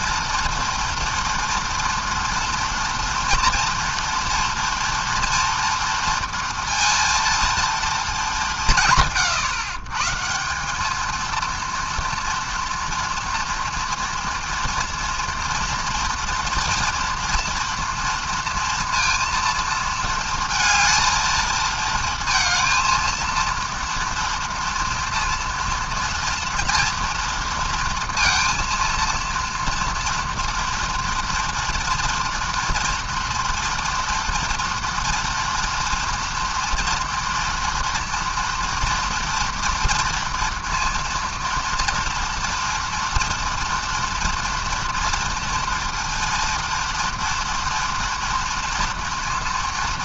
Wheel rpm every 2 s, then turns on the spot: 230, 230, 230, 230, 170, 190, 230, 230, 240, 230, 230, 230, 230, 230, 230, 230, 230, 240, 230, 240, 230, 230, 230, 230, 230.
none